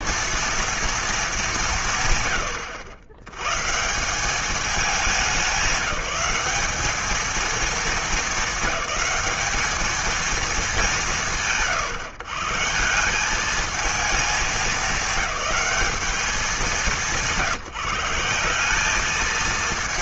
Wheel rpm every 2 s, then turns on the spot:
230, 100, 200, 200, 200, 180, 150, 210, 200, 190.
none